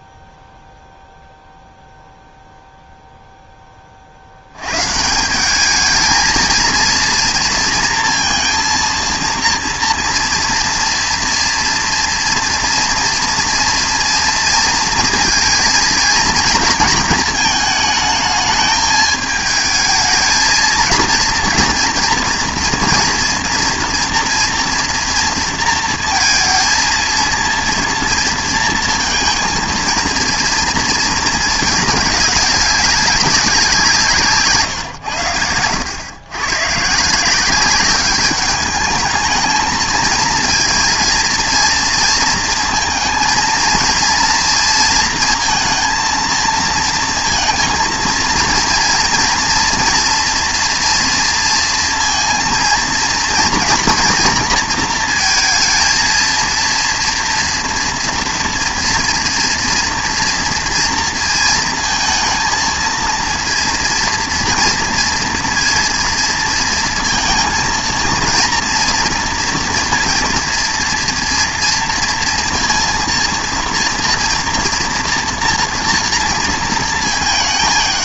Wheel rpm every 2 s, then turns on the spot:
0, 0, 110, 230, 230, 230, 230, 230, 230, 210, 220, 230, 230, 230, 230, 230, 200, 140, 120, 210, 230, 230, 230, 220, 230, 230, 230, 230, 230, 230, 230, 220, 230, 230, 230, 230, 230, 230, 220.
none